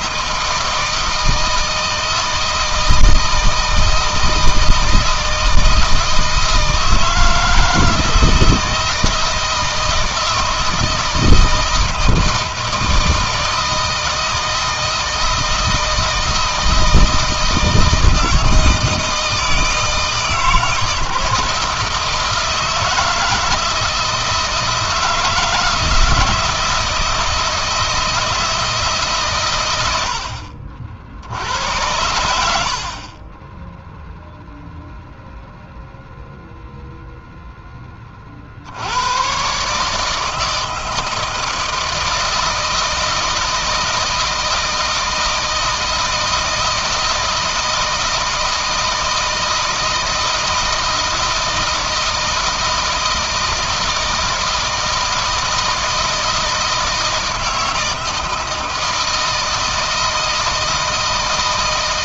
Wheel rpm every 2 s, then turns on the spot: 160, 160, 160, 160, 160, 160, 160, 160, 160, 160, 160, 160, 160, 160, 150, 60, 60, 0, 0, 90, 160, 160, 160, 160, 160, 160, 160, 160, 160, 160, 160.
none